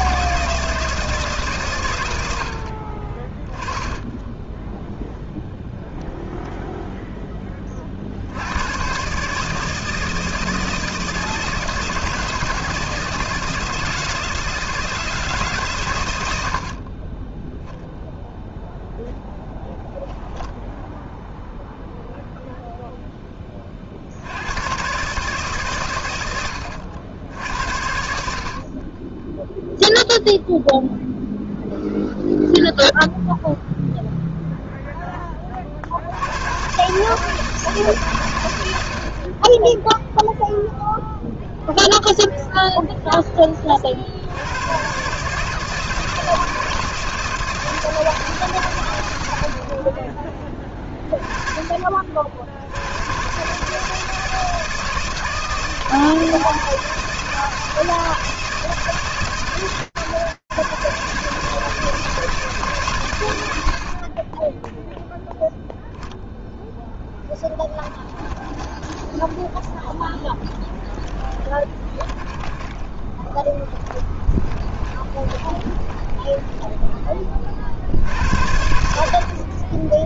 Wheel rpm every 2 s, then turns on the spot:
150, 30, 0, 0, 130, 160, 160, 160, 20, 0, 0, 0, 100, 90, 40, 0, 0, 0, 120, 100, 0, 0, 80, 160, 160, 30, 60, 160, 160, 160, 140, 140, 0, 0, 20, 10, 20, 20, 20, 70.
68-78